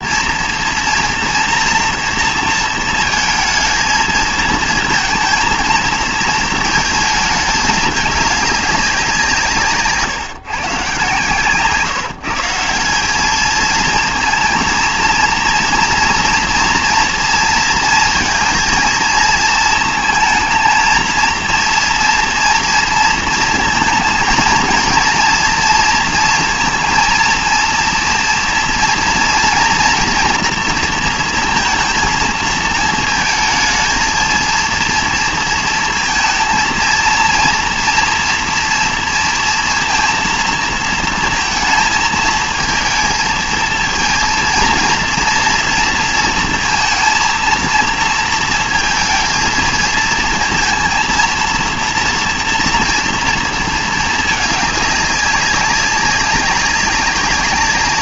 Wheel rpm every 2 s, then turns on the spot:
230, 230, 220, 220, 200, 130, 170, 230, 230, 230, 230, 240, 230, 230, 240, 230, 220, 230, 230, 230, 230, 220, 230, 230, 230, 220, 230, 210, 190.
none